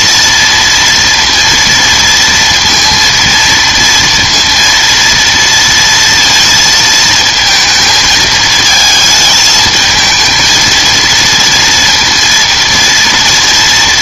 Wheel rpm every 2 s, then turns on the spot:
230, 230, 230, 230, 220, 230, 230.
none